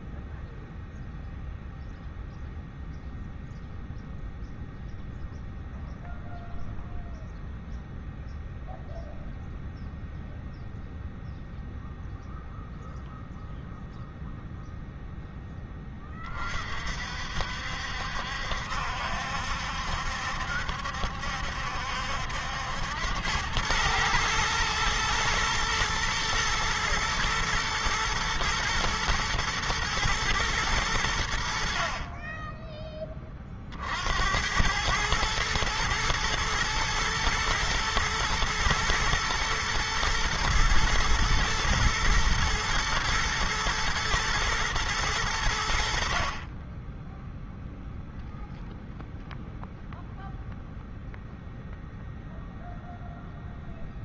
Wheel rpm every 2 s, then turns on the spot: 0, 0, 0, 0, 0, 0, 0, 0, 40, 70, 70, 80, 110, 120, 110, 110, 20, 90, 110, 120, 120, 110, 110, 30, 0, 0, 0.
none